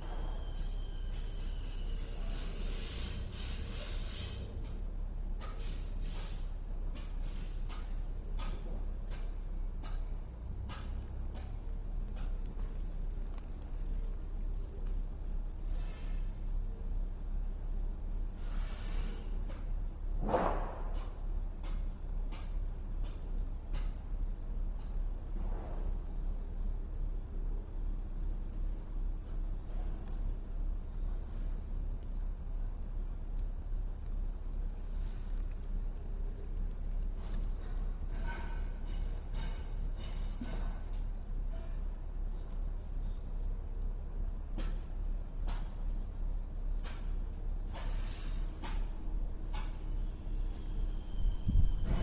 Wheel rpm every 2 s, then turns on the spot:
0, 0, 0, 0, 0, 0, 0, 0, 0, 0, 0, 0, 0, 0, 0, 0, 0, 0, 0, 0, 0, 0, 0, 0, 0, 0.
none